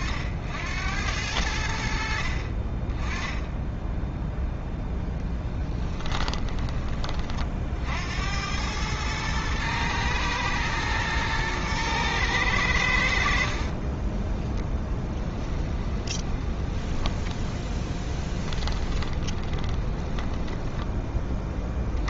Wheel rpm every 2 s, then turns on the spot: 70, 40, 0, 20, 90, 120, 100, 10, 10, 10, 10.
14-16 18-22